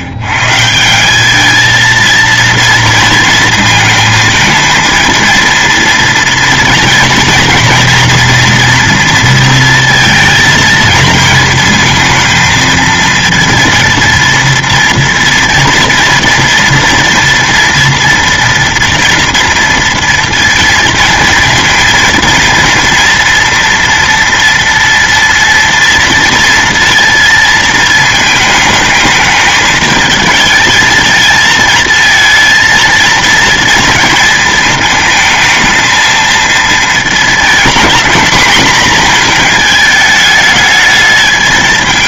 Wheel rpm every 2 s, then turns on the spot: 170, 230, 230, 230, 230, 220, 220, 230, 230, 230, 230, 230, 230, 230, 220, 220, 230, 220, 230, 230, 210.
none